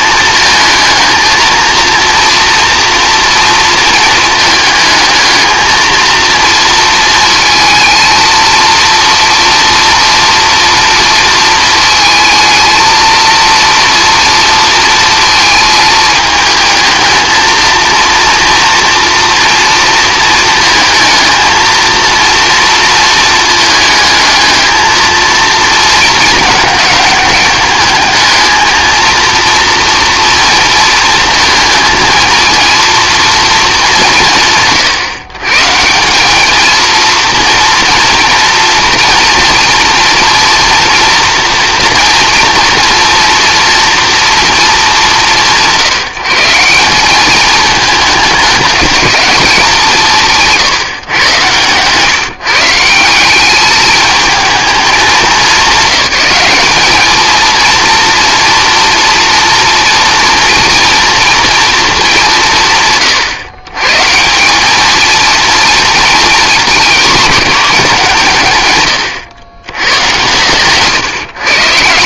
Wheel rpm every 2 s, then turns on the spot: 220, 230, 220, 230, 230, 230, 220, 230, 220, 230, 230, 230, 220, 210, 230, 230, 230, 140, 220, 230, 230, 230, 220, 160, 210, 160, 160, 210, 200, 230, 230, 150, 200, 230, 130, 130.
50-52